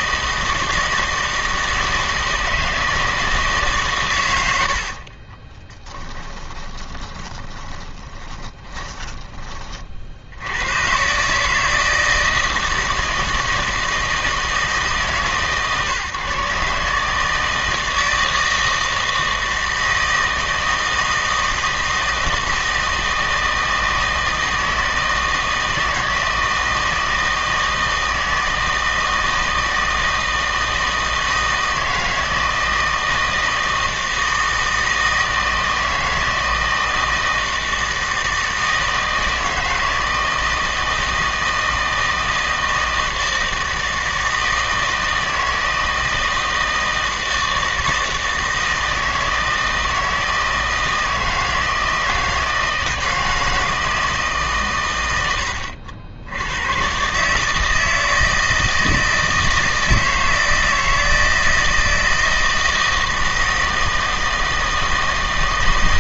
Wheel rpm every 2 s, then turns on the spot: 160, 160, 70, 20, 20, 110, 160, 160, 140, 160, 160, 160, 160, 160, 160, 160, 160, 160, 160, 160, 160, 160, 160, 160, 160, 160, 160, 120, 100, 160, 160, 160, 160.
4-10